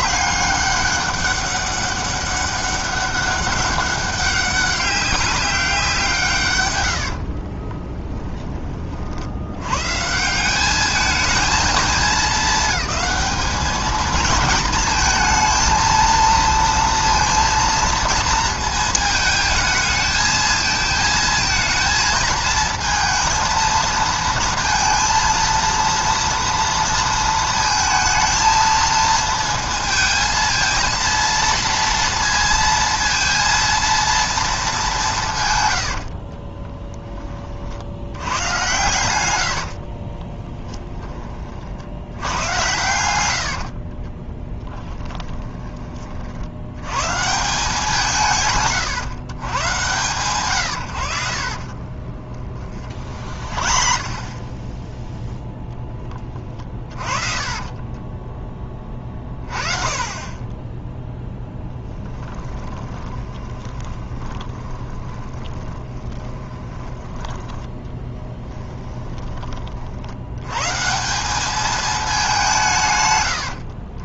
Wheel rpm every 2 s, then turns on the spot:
200, 200, 200, 120, 40, 200, 220, 220, 230, 220, 220, 220, 230, 230, 220, 230, 230, 220, 30, 100, 10, 100, 40, 90, 140, 110, 30, 10, 40, 10, 20, 20, 20, 20, 10, 130, 160.
6-8 36-40 44-46 52-54 56-58 62-70